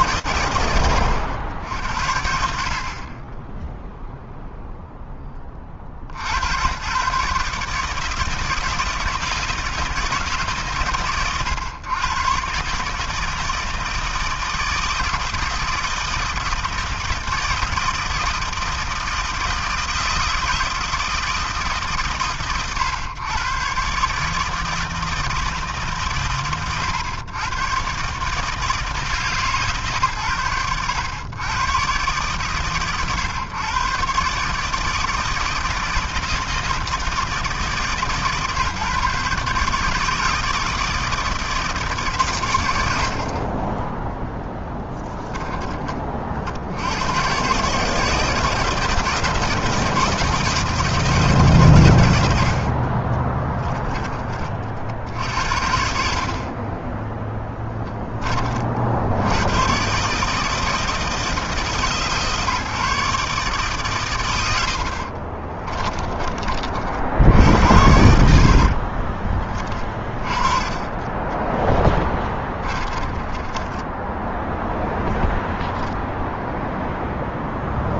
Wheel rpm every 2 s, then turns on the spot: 70, 0, 60, 150, 150, 110, 160, 160, 160, 160, 130, 140, 120, 130, 100, 120, 120, 160, 150, 150, 160, 20, 10, 130, 160, 150, 20, 70, 10, 110, 150, 140, 20, 80, 30, 10, 10, 0, 0.
52-54 56-58 64-66 68-74